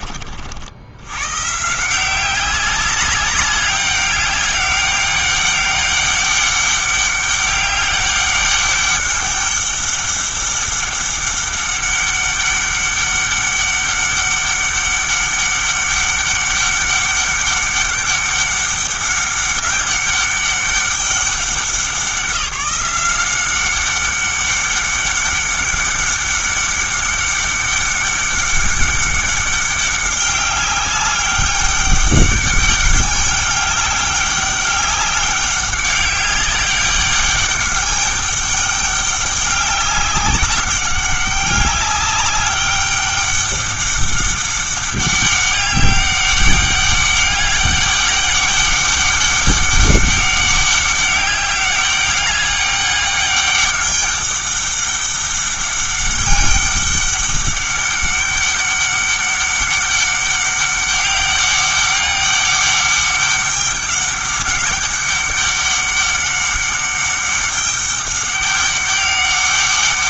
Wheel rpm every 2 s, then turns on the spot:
80, 190, 200, 200, 200, 200, 200, 200, 200, 200, 200, 180, 200, 200, 200, 200, 200, 200, 200, 200, 200, 200, 200, 200, 200, 200, 200, 200, 200, 200, 200, 200, 200, 200, 200.
none